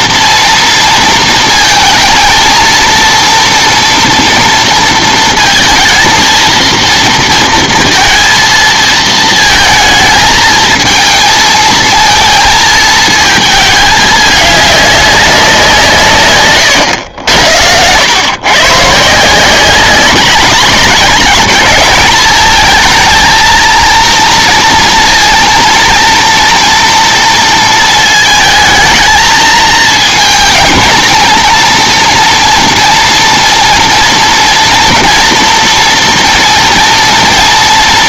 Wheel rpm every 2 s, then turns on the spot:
230, 220, 230, 230, 230, 220, 220, 210, 130, 140, 200, 220, 230, 230, 220, 230, 230, 230, 230.
none